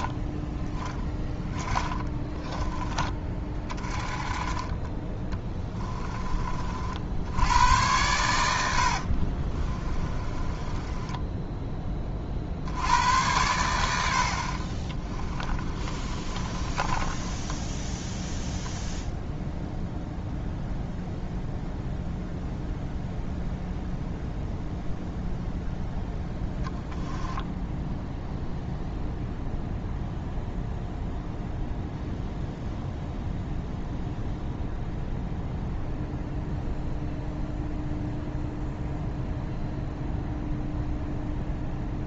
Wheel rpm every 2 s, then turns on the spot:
10, 20, 20, 40, 80, 20, 70, 40, 30, 0, 0, 0, 0, 0, 0, 0, 0, 0, 0, 0, 0.
8-12 14-18